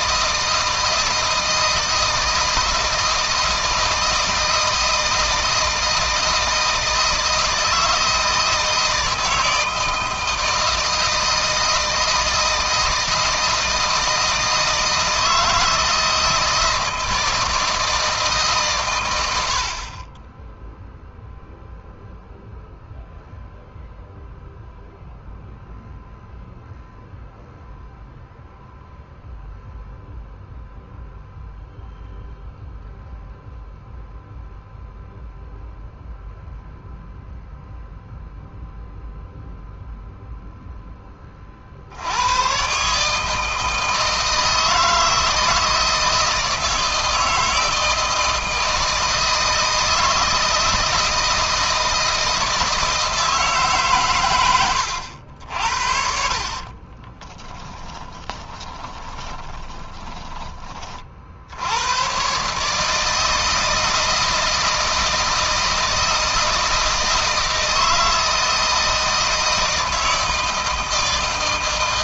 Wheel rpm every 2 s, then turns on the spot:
160, 160, 160, 160, 160, 160, 160, 160, 160, 120, 0, 0, 0, 0, 0, 0, 0, 0, 0, 0, 10, 130, 160, 160, 160, 160, 160, 100, 40, 20, 30, 150, 160, 160, 160, 160.
56-60